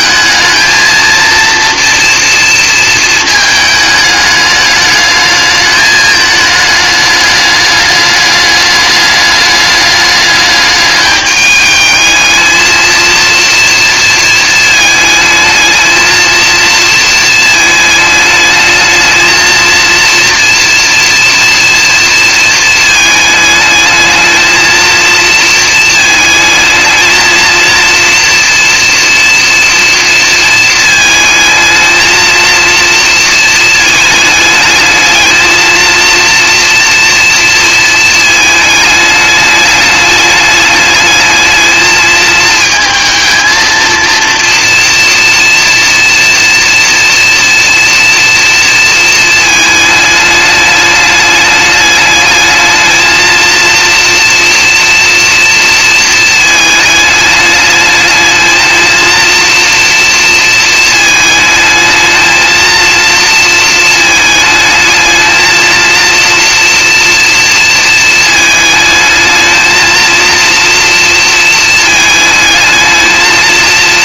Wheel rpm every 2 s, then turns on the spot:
230, 230, 210, 210, 210, 210, 220, 220, 230, 220, 240, 220, 230, 220, 240, 220, 230, 220, 230, 210, 210, 220, 230, 230, 230, 210, 220, 230, 220, 230, 220, 230, 220, 240, 220, 230, 220.
none